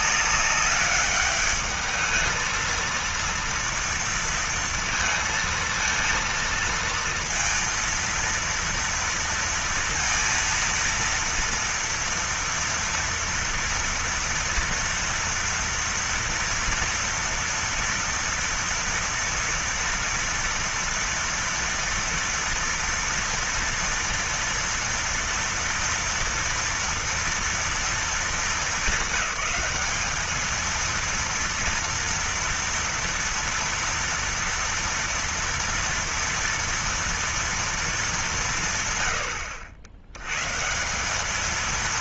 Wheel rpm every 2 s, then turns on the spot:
200, 220, 230, 230, 230, 230, 230, 230, 230, 230, 230, 230, 230, 230, 210, 220, 240, 240, 240, 170, 140.
none